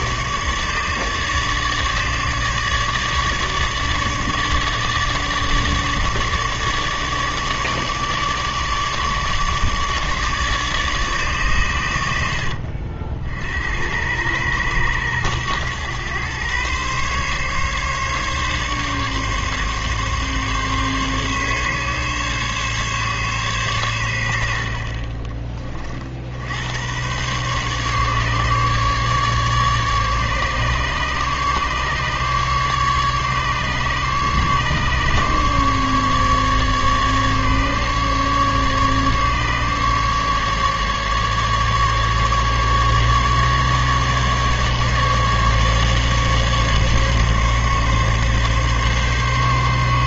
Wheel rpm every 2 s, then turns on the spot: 150, 150, 150, 150, 150, 150, 70, 110, 120, 140, 140, 140, 60, 90, 150, 150, 150, 140, 150, 150, 140, 150, 150, 140, 140.
none